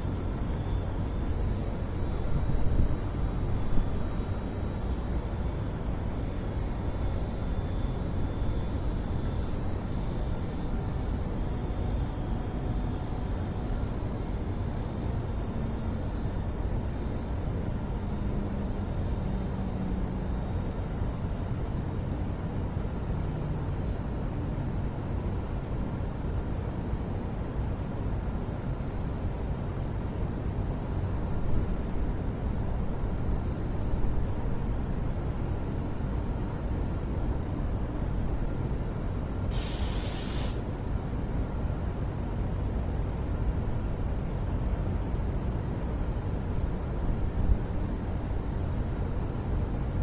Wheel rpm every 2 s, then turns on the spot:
0, 0, 0, 0, 0, 0, 0, 0, 0, 0, 0, 0, 0, 0, 0, 0, 0, 0, 0, 0, 0, 0, 0, 0, 0.
none